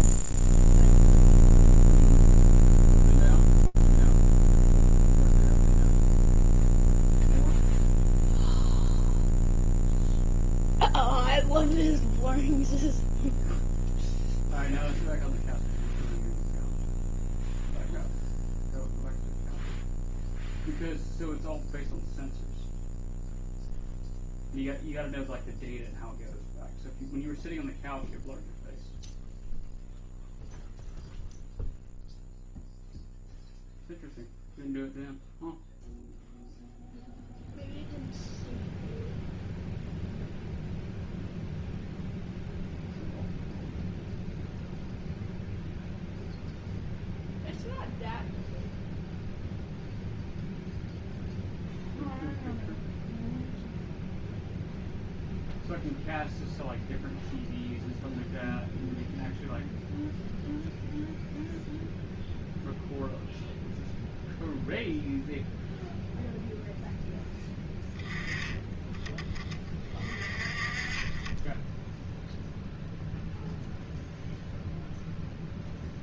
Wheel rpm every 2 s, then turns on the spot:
0, 0, 0, 0, 0, 0, 0, 0, 0, 0, 0, 0, 0, 0, 0, 0, 0, 0, 0, 0, 0, 0, 0, 0, 0, 0, 0, 0, 0, 0, 0, 0, 0, 0, 10, 30, 0, 0.
none